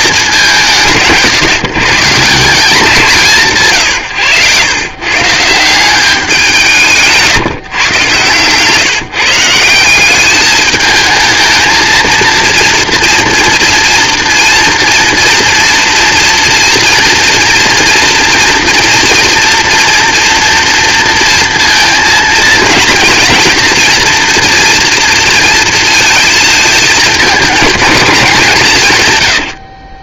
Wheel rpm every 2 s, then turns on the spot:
150, 180, 130, 160, 150, 220, 230, 230, 230, 230, 230, 230, 240, 220, 150.
none